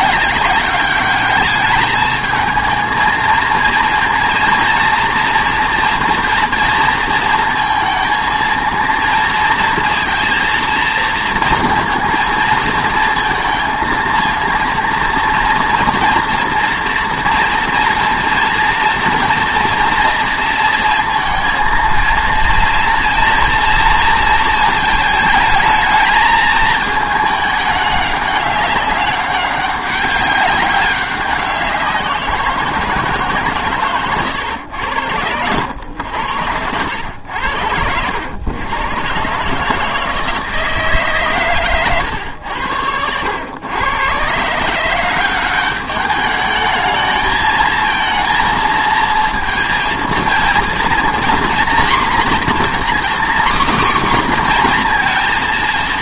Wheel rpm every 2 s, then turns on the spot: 200, 220, 230, 230, 230, 230, 230, 230, 240, 230, 230, 230, 220, 220, 200, 200, 170, 100, 90, 110, 160, 90, 160, 210, 230, 230, 260, 240.
none